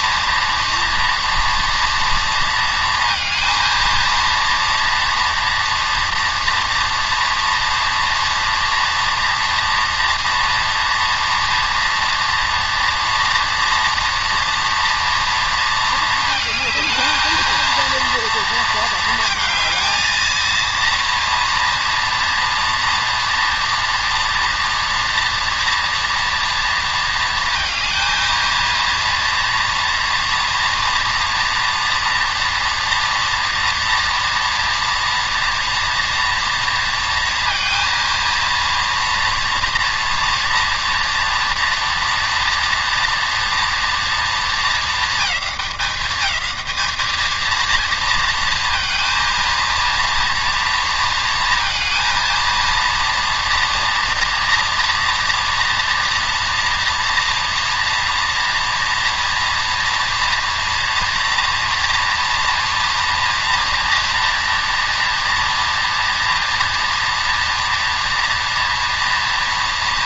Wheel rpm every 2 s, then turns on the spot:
240, 230, 230, 240, 240, 230, 240, 230, 220, 220, 230, 230, 230, 230, 230, 230, 230, 230, 230, 230, 230, 230, 210, 220, 230, 230, 230, 230, 230, 230, 230, 230, 230, 230, 230.
none